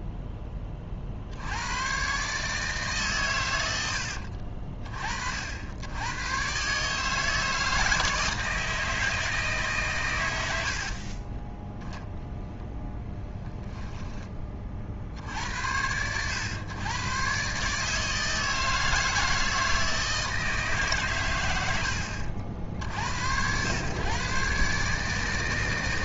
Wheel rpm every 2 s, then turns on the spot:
20, 150, 50, 140, 160, 80, 0, 40, 110, 160, 140, 50, 150.
10-12